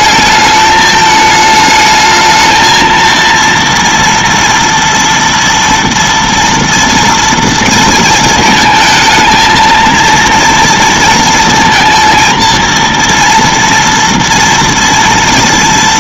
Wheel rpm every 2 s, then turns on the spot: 210, 220, 230, 230, 230, 230, 230, 230.
none